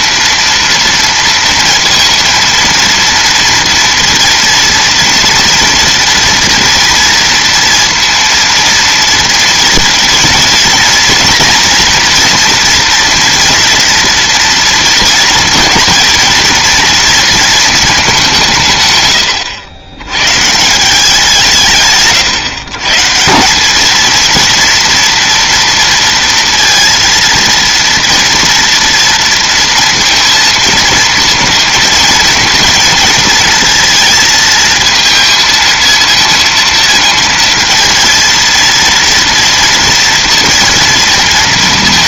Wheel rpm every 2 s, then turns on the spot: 230, 230, 240, 230, 230, 230, 230, 230, 230, 180, 130, 140, 230, 230, 230, 230, 230, 220, 230, 230, 230.
none